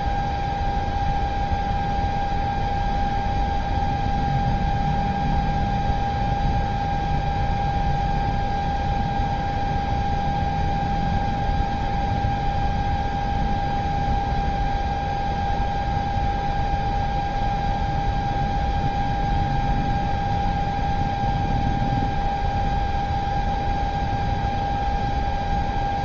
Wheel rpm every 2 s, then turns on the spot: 0, 0, 0, 0, 0, 0, 0, 0, 0, 0, 0, 0, 0.
none